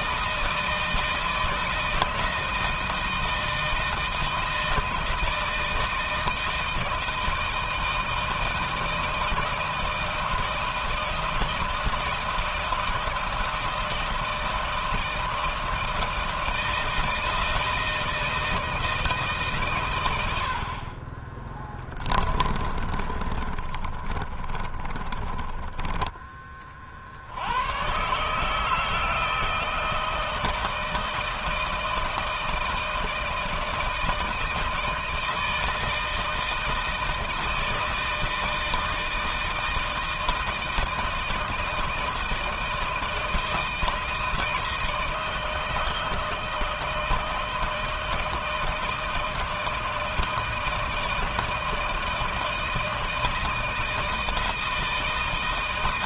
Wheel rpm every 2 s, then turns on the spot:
160, 160, 160, 160, 160, 160, 160, 160, 160, 160, 30, 30, 20, 50, 160, 160, 160, 160, 160, 160, 160, 160, 160, 160, 160, 160, 160, 160.
22-26